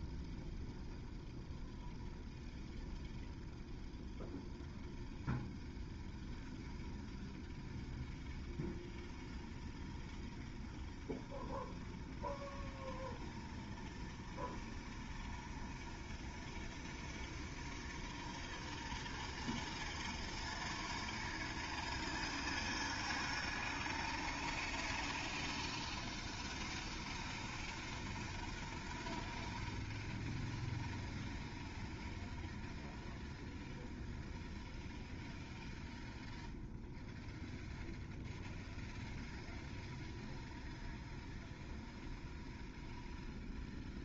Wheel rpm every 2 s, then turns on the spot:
0, 0, 0, 0, 0, 0, 0, 0, 0, 0, 0, 0, 0, 0, 0, 0, 0, 0, 0, 0, 0, 0.
none